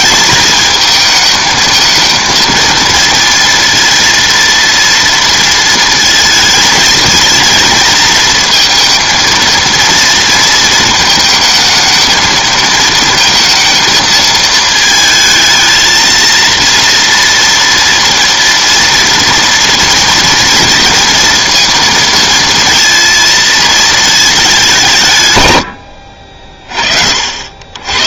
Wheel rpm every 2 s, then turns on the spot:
210, 230, 230, 220, 230, 230, 220, 220, 230, 230, 230, 230, 200, 40.
none